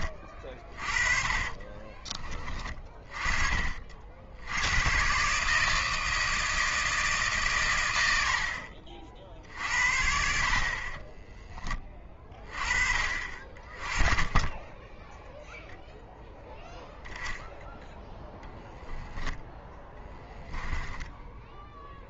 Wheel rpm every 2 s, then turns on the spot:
40, 30, 100, 160, 50, 50, 30, 20, 10, 10, 10.
0-2 20-22